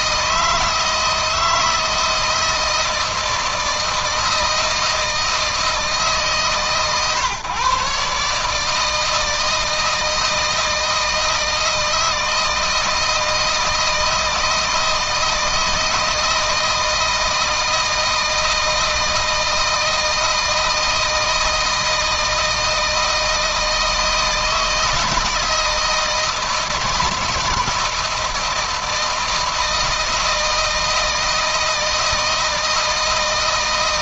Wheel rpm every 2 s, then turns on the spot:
160, 160, 160, 140, 160, 160, 160, 160, 160, 160, 160, 160, 160, 160, 160, 160, 160.
none